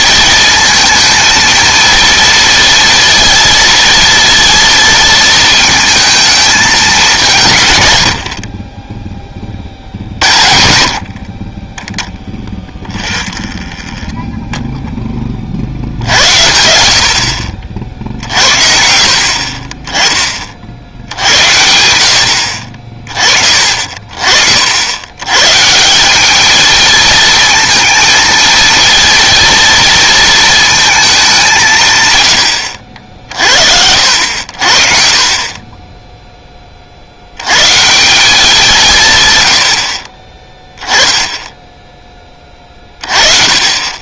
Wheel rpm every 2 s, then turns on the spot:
230, 230, 230, 200, 20, 70, 10, 0, 70, 60, 60, 50, 70, 220, 230, 220, 90, 50, 30, 170, 10, 20.
12-14